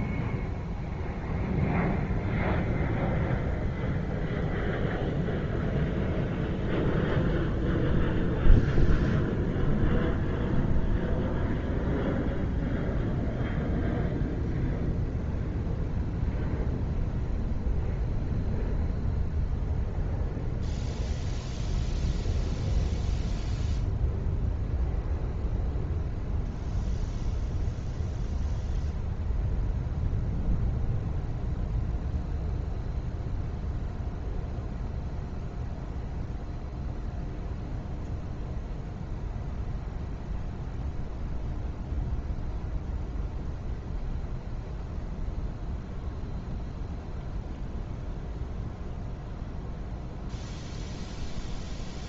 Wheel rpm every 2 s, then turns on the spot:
0, 0, 0, 0, 0, 0, 0, 0, 0, 0, 0, 0, 0, 0, 0, 0, 0, 0, 0, 0, 0, 0, 0, 0, 0, 0.
none